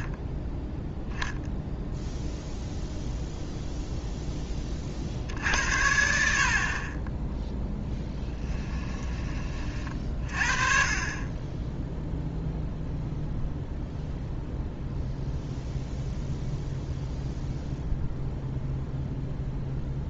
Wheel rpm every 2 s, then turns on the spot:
0, 0, 20, 40, 10, 40, 0, 0, 0, 0.
8-10